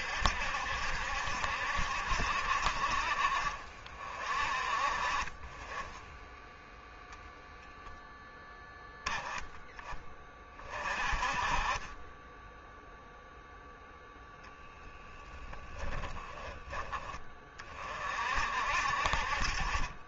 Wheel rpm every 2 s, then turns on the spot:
70, 60, 40, 0, 0, 30, 0, 10, 30, 50.
14-16